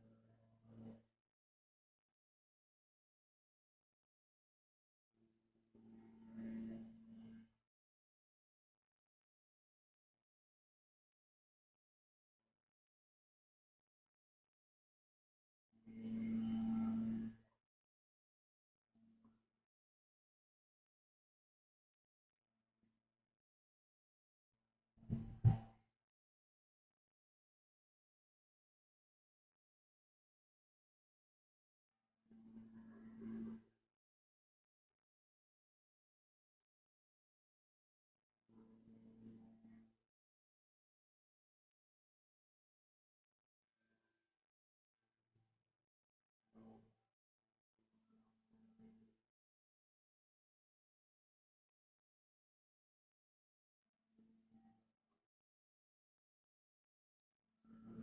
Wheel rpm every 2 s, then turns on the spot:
0, 0, 0, 0, 0, 0, 0, 0, 0, 0, 0, 0, 0, 0, 0, 0, 0, 0, 0, 0, 0, 0, 0, 0, 0, 0, 0, 0, 0.
none